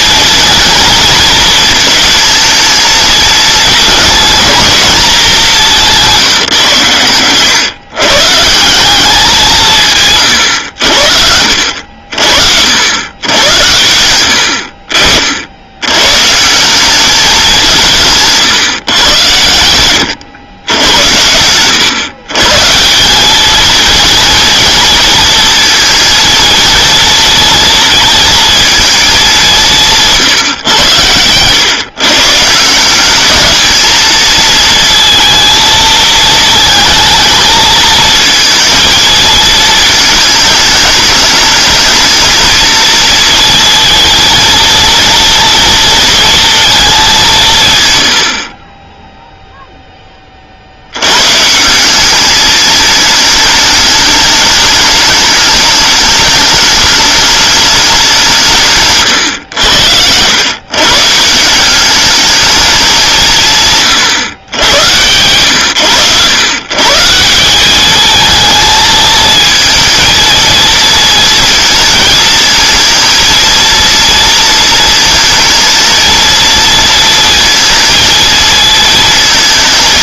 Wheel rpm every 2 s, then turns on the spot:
230, 220, 230, 130, 180, 80, 80, 60, 190, 130, 100, 170, 230, 230, 220, 110, 170, 230, 220, 220, 210, 230, 230, 210, 20, 80, 210, 210, 210, 140, 140, 210, 110, 140, 220, 230, 220, 230, 230, 220.
none